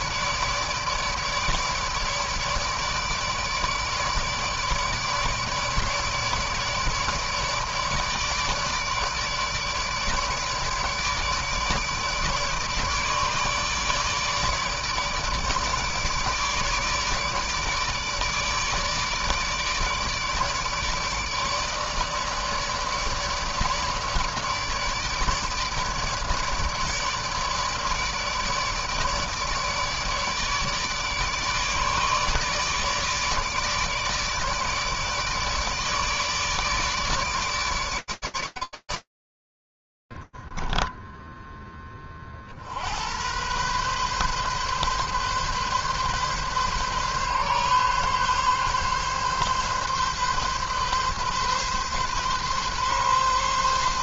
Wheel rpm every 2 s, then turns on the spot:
150, 150, 150, 150, 150, 150, 150, 150, 150, 150, 150, 150, 150, 150, 150, 150, 150, 150, 150, 150, 50, 40, 130, 140, 140, 140, 140.
40-42